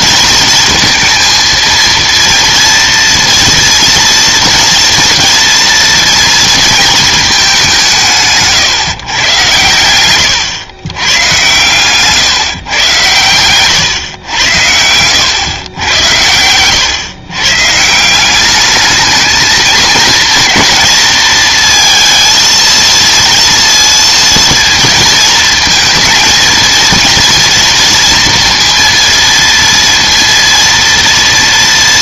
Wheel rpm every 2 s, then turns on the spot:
230, 230, 230, 220, 140, 110, 120, 90, 110, 210, 230, 230, 230, 230, 230, 230.
14-16